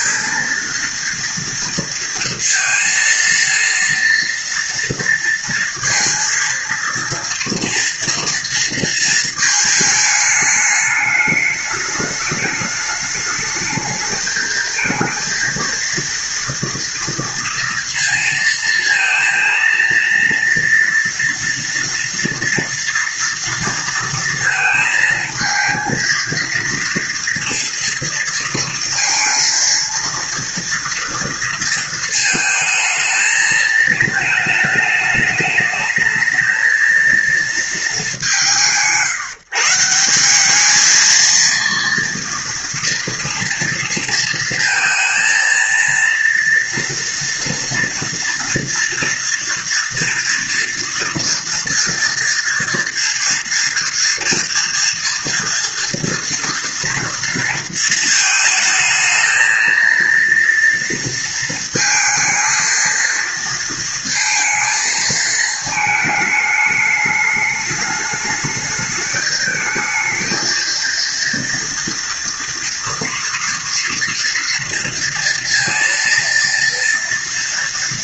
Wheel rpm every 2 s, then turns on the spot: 230, 230, 230, 230, 230, 210, 210, 220, 230, 230, 230, 230, 230, 230, 230, 230, 220, 220, 220, 160, 210, 230, 230, 230, 230, 230, 240, 230, 230, 220, 230, 230, 230, 210, 210, 230, 230, 230, 230.
none